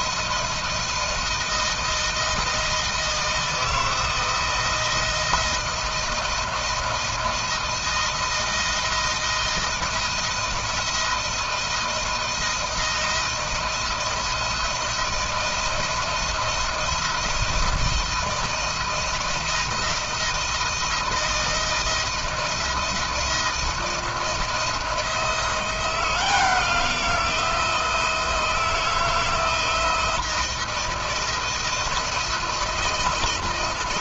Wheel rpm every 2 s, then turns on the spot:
160, 160, 160, 170, 160, 170, 160, 170, 170, 170, 160, 170, 160, 170, 170, 160, 160.
none